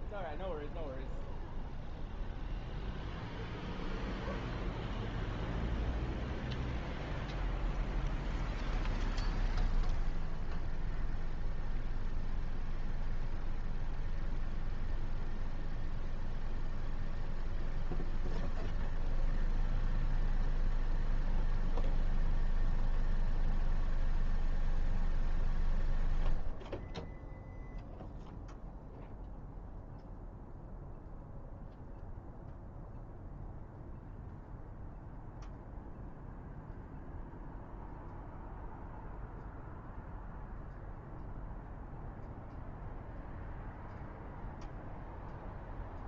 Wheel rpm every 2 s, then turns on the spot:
0, 0, 0, 0, 0, 0, 0, 0, 0, 0, 0, 0, 0, 0, 0, 0, 0, 0, 0, 0, 0, 0, 0.
none